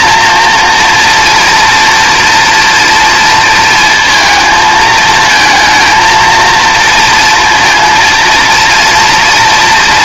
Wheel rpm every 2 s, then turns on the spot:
230, 240, 220, 230, 230.
none